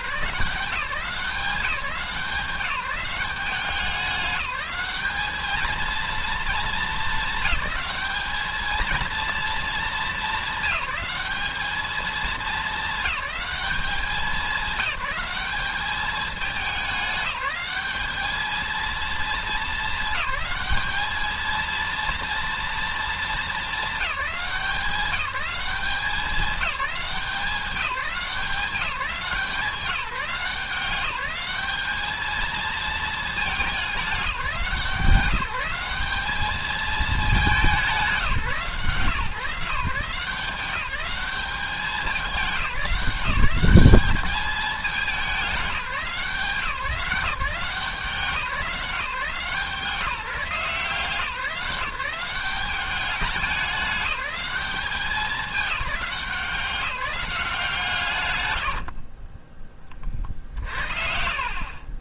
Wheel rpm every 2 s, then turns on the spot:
180, 190, 210, 220, 220, 210, 220, 190, 210, 220, 210, 230, 190, 200, 180, 180, 220, 180, 210, 160, 190, 190, 210, 170, 180, 170, 190, 190, 180, 60, 60.
58-60